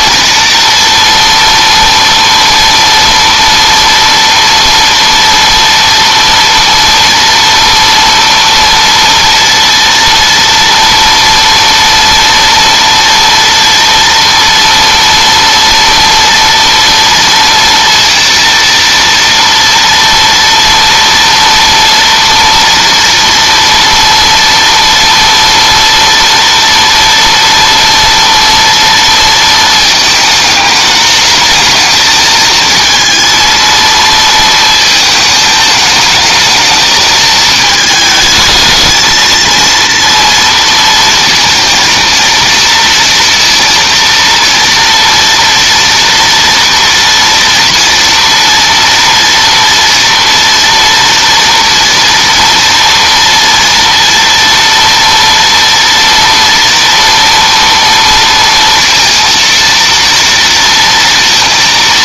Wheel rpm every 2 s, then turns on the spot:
230, 240, 230, 240, 230, 230, 230, 240, 230, 230, 230, 230, 230, 230, 230, 220, 220, 230, 220, 220, 230, 230, 230, 240, 230, 230, 230, 230, 230, 230, 230.
none